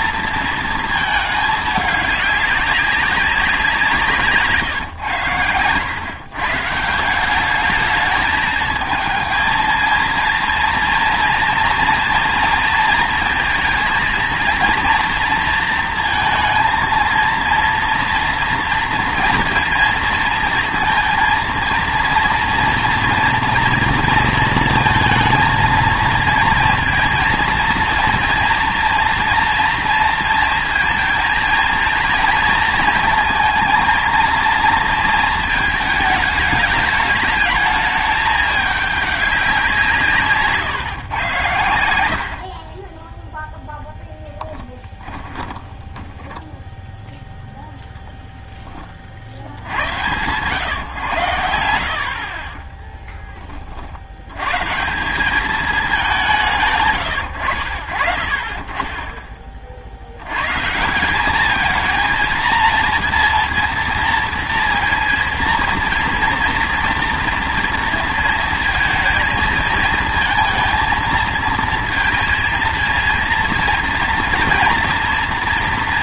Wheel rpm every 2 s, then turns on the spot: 230, 200, 150, 140, 220, 230, 230, 230, 230, 230, 230, 230, 230, 230, 240, 230, 230, 230, 210, 210, 150, 30, 10, 0, 10, 120, 30, 130, 150, 30, 140, 230, 230, 230, 220, 230, 230, 230.
44-46